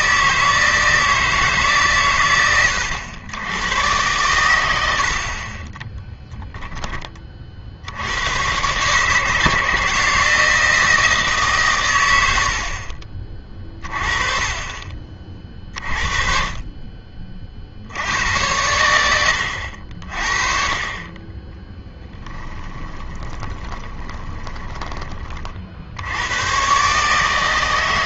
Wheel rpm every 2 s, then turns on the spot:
160, 100, 100, 10, 130, 160, 70, 30, 40, 100, 40, 10, 10, 120.
22-26